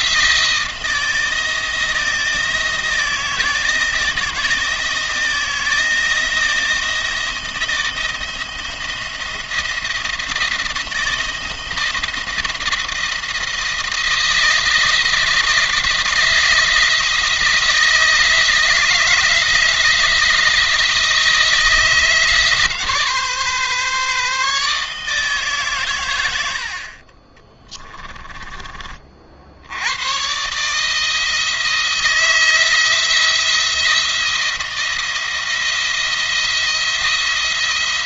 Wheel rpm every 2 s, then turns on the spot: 160, 170, 160, 170, 170, 160, 170, 170, 160, 160, 160, 150, 150, 60, 30, 150, 170, 170, 170.
none